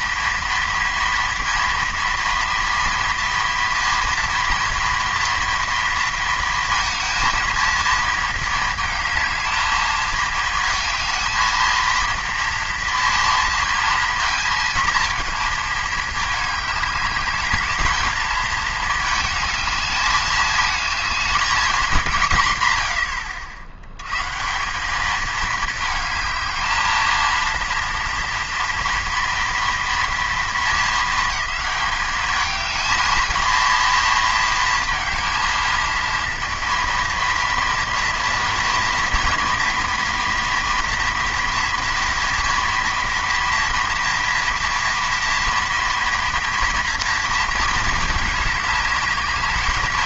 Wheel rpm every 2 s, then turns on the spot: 230, 230, 230, 230, 220, 220, 230, 230, 210, 220, 220, 70, 210, 220, 230, 220, 220, 220, 230, 240, 230, 230, 230, 230, 210.
none